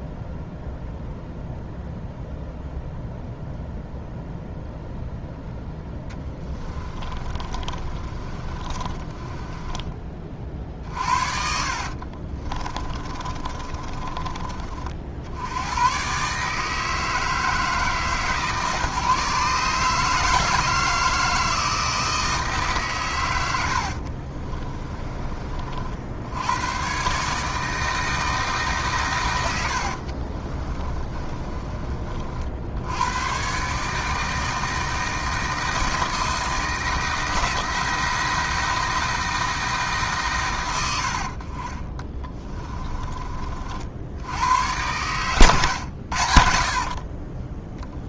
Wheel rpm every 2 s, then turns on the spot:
0, 0, 0, 30, 20, 50, 30, 50, 160, 140, 160, 130, 30, 130, 140, 30, 90, 160, 160, 170, 80, 20, 110, 60.
6-14 24-26 30-32 46-48